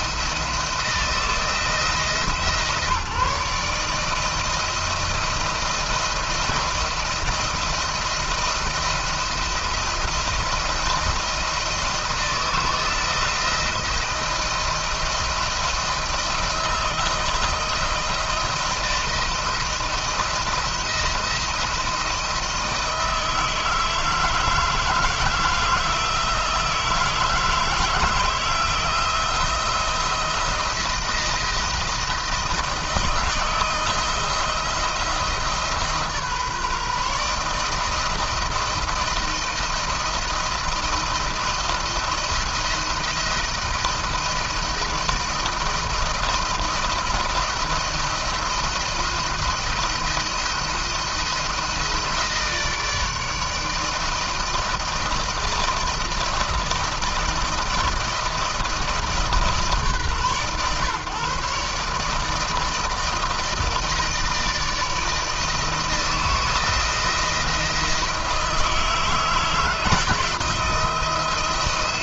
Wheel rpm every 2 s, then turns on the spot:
170, 160, 160, 170, 170, 170, 170, 170, 170, 170, 170, 160, 160, 160, 170, 170, 170, 170, 150, 170, 160, 170, 170, 170, 170, 170, 160, 160, 170, 160, 130, 160, 160, 170, 160, 160.
none